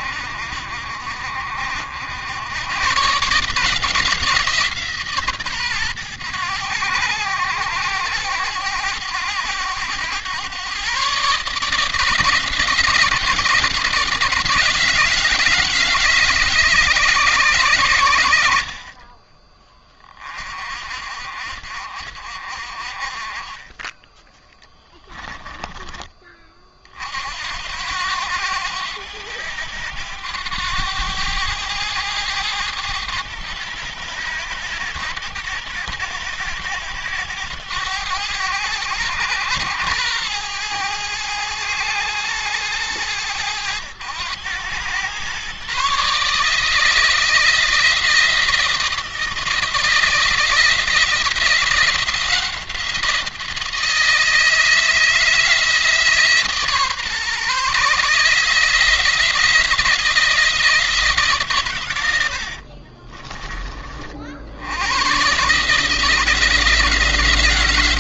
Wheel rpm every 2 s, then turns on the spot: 60, 130, 150, 90, 90, 130, 160, 160, 140, 40, 50, 40, 10, 50, 100, 100, 100, 100, 100, 100, 110, 100, 110, 160, 160, 170, 170, 160, 140, 160, 160, 40, 100, 170.
24-26 62-64